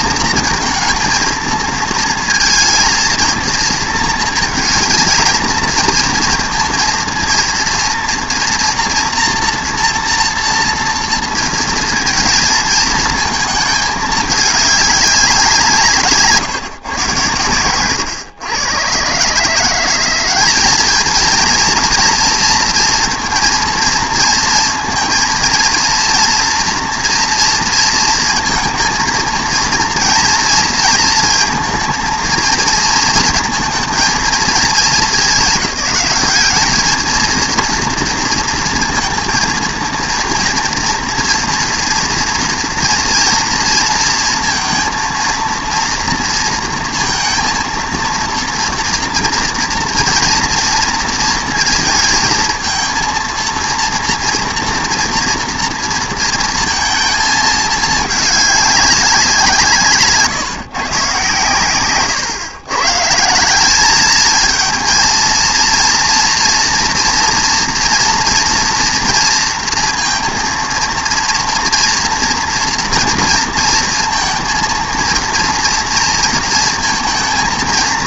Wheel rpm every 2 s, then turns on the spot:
230, 230, 220, 230, 230, 230, 220, 210, 140, 110, 210, 230, 230, 240, 230, 230, 220, 220, 210, 230, 230, 230, 230, 230, 230, 230, 230, 230, 230, 200, 120, 120, 220, 230, 230, 230, 230, 230, 230.
none